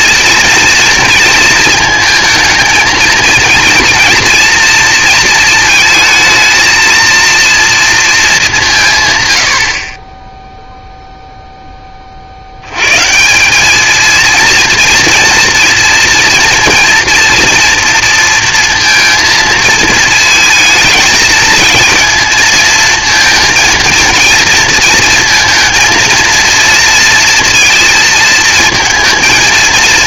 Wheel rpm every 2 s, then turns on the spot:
230, 220, 230, 230, 180, 0, 90, 230, 240, 230, 220, 230, 230, 230, 220.
none